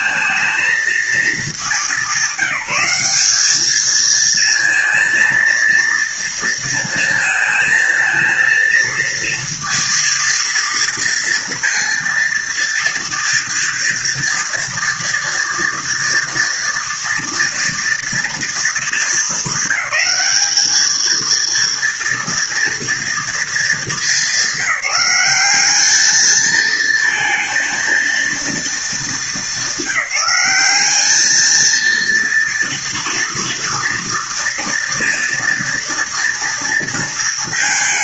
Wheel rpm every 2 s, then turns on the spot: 230, 190, 230, 230, 220, 230, 230, 230, 230, 230, 220, 230, 210, 220, 230, 190, 230, 230, 230.
none